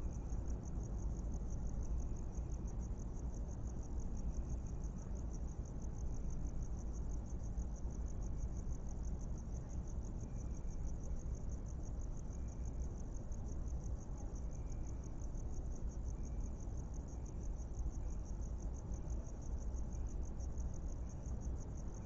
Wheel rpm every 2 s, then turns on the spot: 0, 0, 0, 0, 0, 0, 0, 0, 0, 0, 0.
none